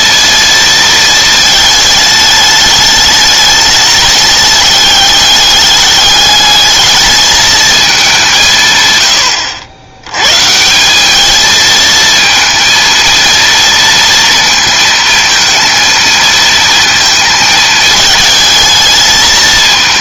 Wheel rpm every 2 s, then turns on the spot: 230, 210, 210, 210, 150, 150, 230, 230, 230, 220.
none